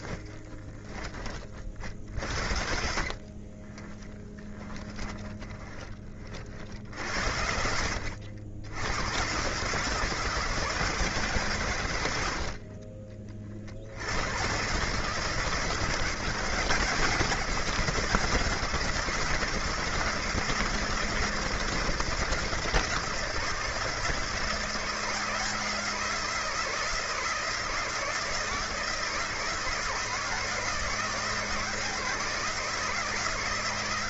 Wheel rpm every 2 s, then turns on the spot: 20, 50, 20, 70, 100, 160, 40, 140, 170, 170, 160, 160, 160, 160, 160, 160, 160.
2-6